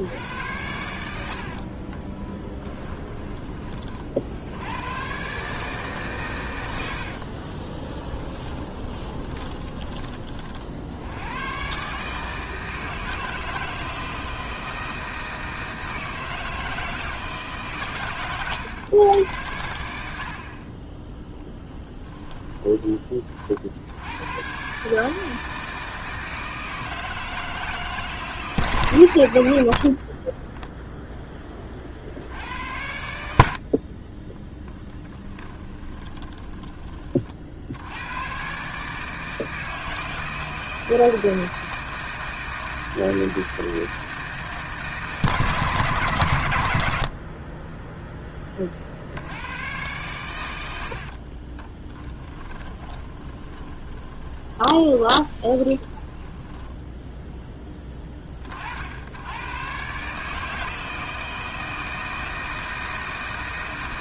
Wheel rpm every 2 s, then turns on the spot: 90, 10, 80, 100, 20, 50, 160, 160, 160, 120, 40, 20, 130, 160, 120, 0, 80, 30, 30, 130, 160, 160, 160, 120, 30, 80, 20, 20, 10, 50, 160, 160.
2-4 8-10 22-24 34-36 52-58